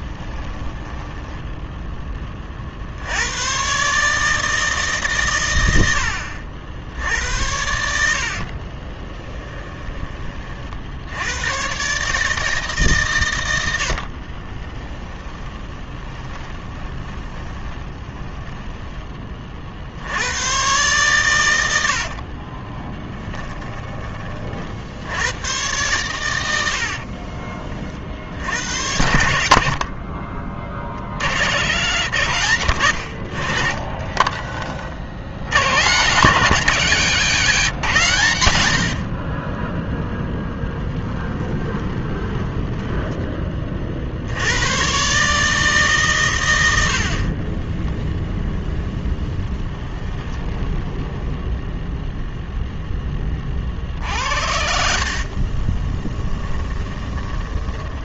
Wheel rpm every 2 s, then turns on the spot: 10, 60, 150, 60, 40, 60, 150, 20, 20, 10, 120, 20, 60, 70, 80, 50, 100, 40, 160, 70, 10, 10, 120, 80, 10, 10, 10, 70, 20.
0-2 8-10 14-18 22-24 26-28 38-44 48-52 54-58